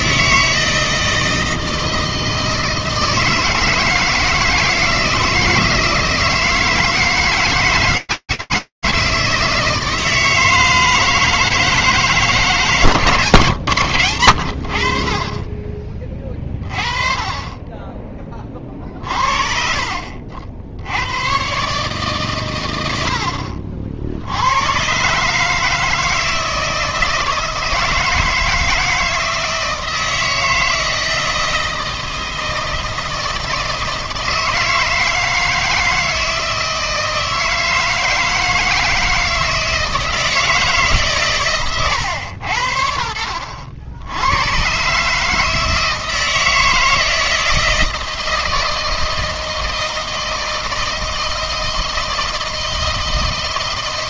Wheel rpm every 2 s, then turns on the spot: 160, 160, 160, 160, 160, 160, 140, 40, 30, 40, 70, 100, 110, 160, 160, 160, 160, 160, 160, 160, 150, 70, 120, 160, 160, 160, 160.
none